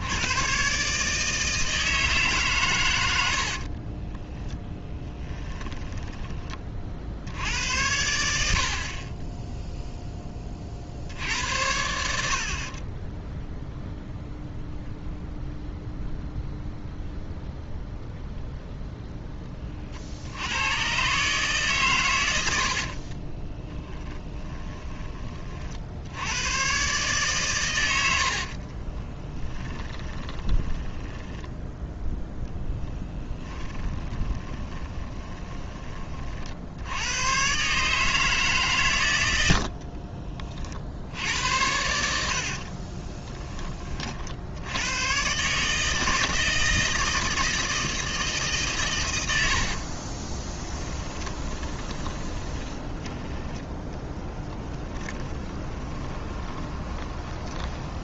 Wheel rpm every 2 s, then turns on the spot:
140, 120, 10, 40, 50, 40, 40, 0, 0, 0, 110, 50, 20, 120, 30, 10, 10, 30, 70, 130, 60, 40, 90, 160, 140, 20, 20, 10, 30.
4-6 22-26 28-30 32-36 42-44 50-58